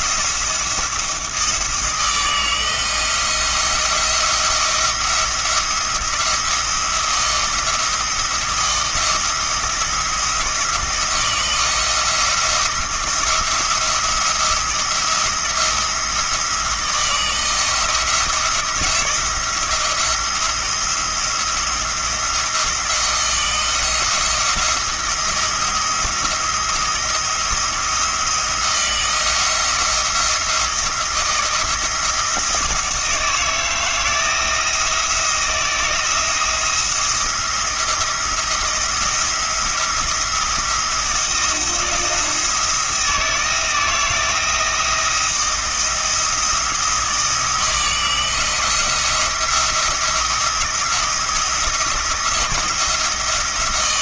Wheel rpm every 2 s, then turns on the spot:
170, 170, 170, 170, 170, 170, 170, 170, 170, 170, 170, 170, 170, 170, 170, 170, 170, 160, 170, 170, 160, 170, 170, 160, 170, 170, 170.
none